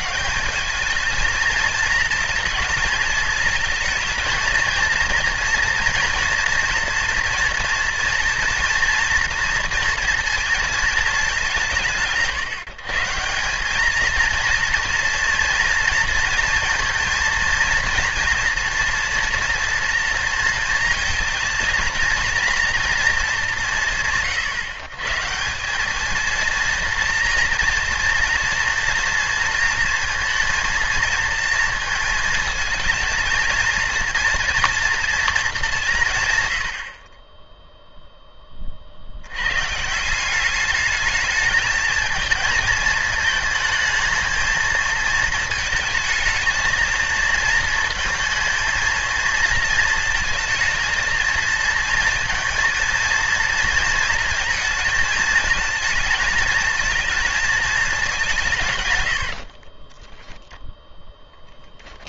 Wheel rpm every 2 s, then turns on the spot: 130, 220, 230, 230, 230, 230, 180, 220, 230, 230, 230, 230, 160, 220, 230, 230, 230, 230, 150, 10, 190, 220, 220, 220, 230, 230, 230, 230, 220, 180, 10.
60-62